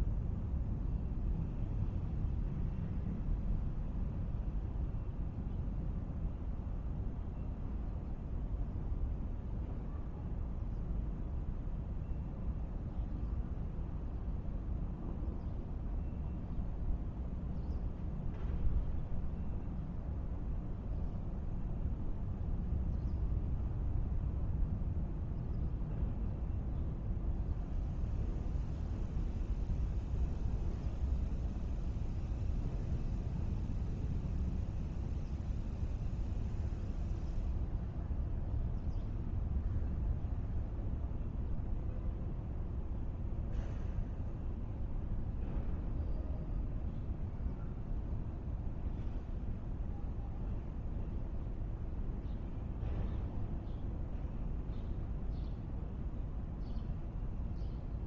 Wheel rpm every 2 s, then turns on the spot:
0, 0, 0, 0, 0, 0, 0, 0, 0, 0, 0, 0, 0, 0, 0, 0, 0, 0, 0, 0, 0, 0, 0, 0, 0, 0, 0, 0, 0.
none